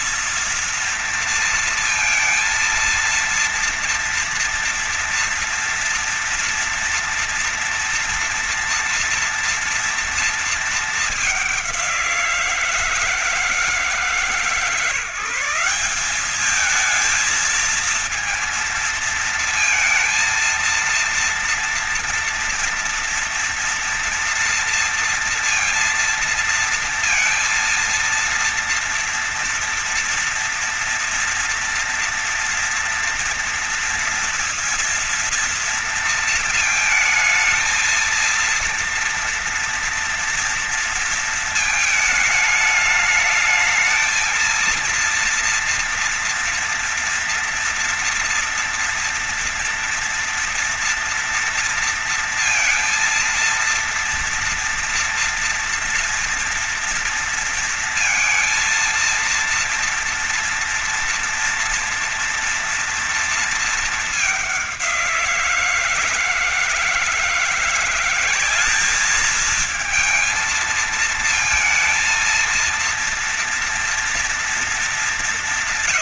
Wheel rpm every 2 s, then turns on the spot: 230, 230, 230, 230, 230, 210, 170, 160, 220, 230, 230, 230, 230, 230, 230, 230, 230, 230, 220, 230, 230, 220, 230, 230, 230, 240, 230, 240, 230, 230, 230, 230, 180, 160, 200, 220, 230, 220.
none